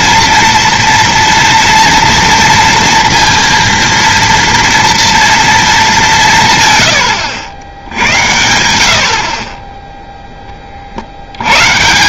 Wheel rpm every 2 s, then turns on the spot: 230, 230, 230, 140, 80, 30.
none